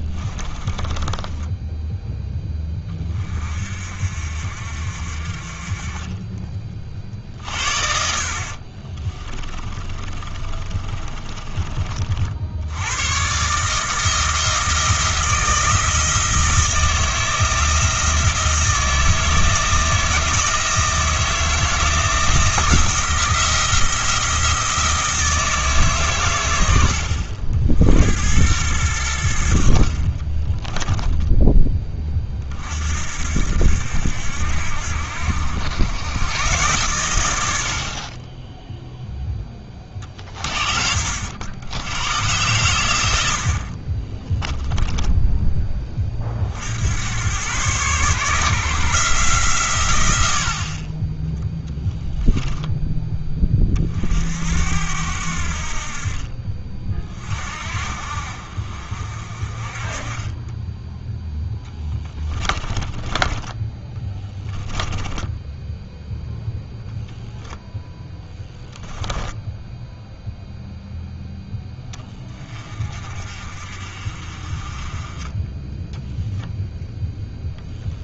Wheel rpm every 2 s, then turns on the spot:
20, 10, 50, 40, 40, 30, 90, 160, 170, 160, 160, 170, 160, 100, 100, 10, 50, 70, 110, 0, 40, 100, 10, 70, 150, 50, 10, 80, 40, 50, 10, 20, 10, 0, 10, 0, 30, 30, 0.
0-2 8-12 30-32 62-66 68-70